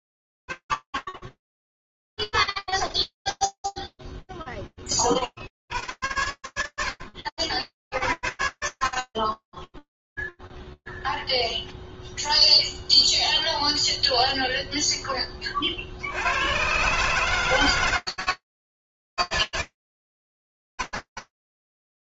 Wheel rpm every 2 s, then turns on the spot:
50, 20, 0, 70, 60, 0, 0, 0, 120, 160, 150.
none